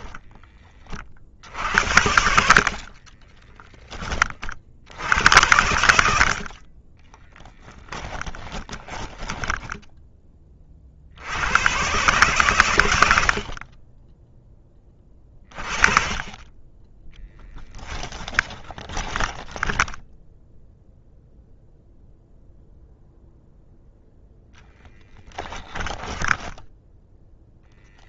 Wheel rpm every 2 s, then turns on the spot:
40, 50, 90, 30, 20, 60, 90, 30, 20, 10, 0, 0, 0, 0.
2-4 6-10 16-20